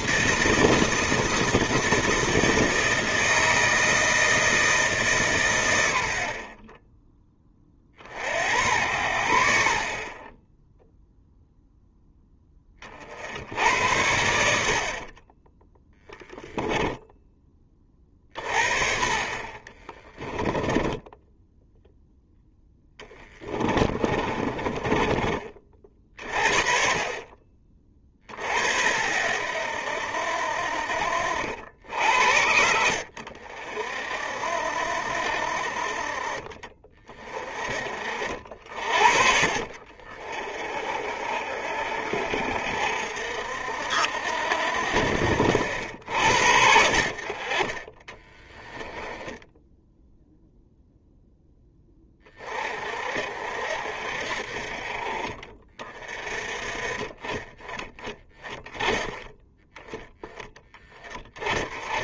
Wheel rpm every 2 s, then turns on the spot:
160, 160, 150, 20, 80, 0, 40, 50, 10, 40, 10, 10, 20, 40, 70, 60, 80, 60, 40, 60, 50, 60, 60, 60, 10, 0, 40, 40, 30, 20, 20.
14-16 20-26 48-50